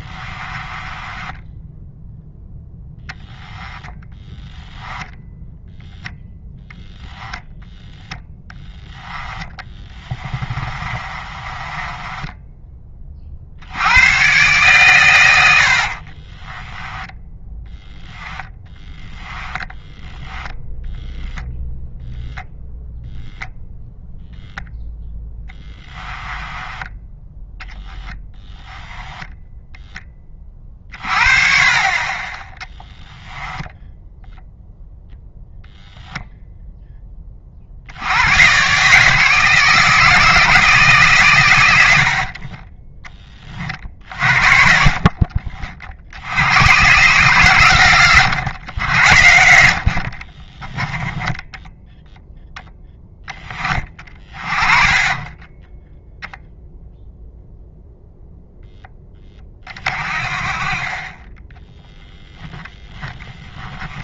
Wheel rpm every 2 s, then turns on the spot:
20, 0, 0, 10, 10, 20, 20, 130, 10, 10, 10, 0, 0, 10, 10, 30, 20, 0, 10, 140, 160, 20, 40, 120, 90, 20, 10, 30, 0, 10, 30, 10.
0-2 8-12 16-20 26-28 32-34 42-44 50-52 62-64